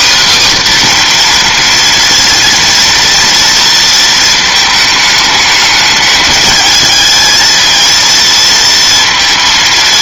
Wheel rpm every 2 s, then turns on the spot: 260, 230, 220, 210, 230.
none